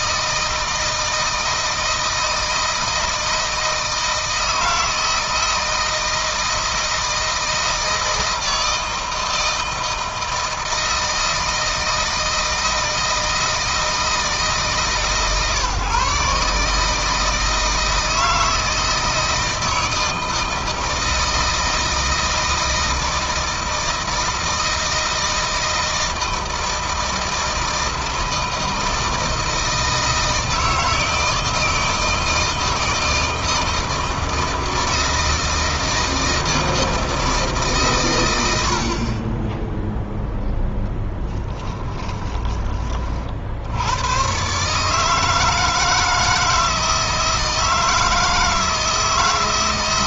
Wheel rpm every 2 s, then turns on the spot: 160, 160, 160, 160, 160, 160, 160, 150, 150, 160, 160, 160, 160, 160, 160, 160, 160, 160, 160, 80, 10, 30, 140, 160, 160.
none